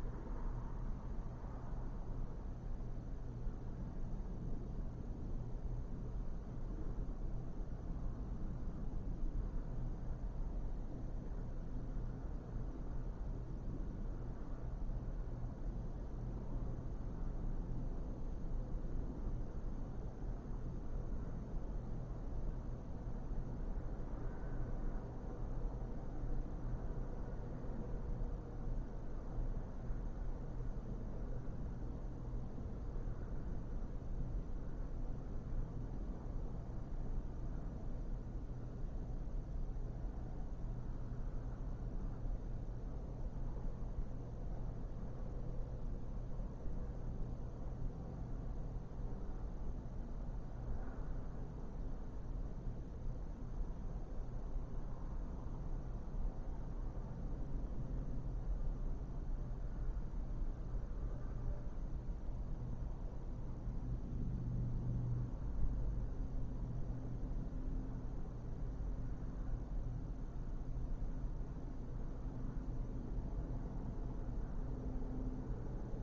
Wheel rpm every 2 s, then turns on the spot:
0, 0, 0, 0, 0, 0, 0, 0, 0, 0, 0, 0, 0, 0, 0, 0, 0, 0, 0, 0, 0, 0, 0, 0, 0, 0, 0, 0, 0, 0, 0, 0, 0, 0, 0, 0, 0, 0.
none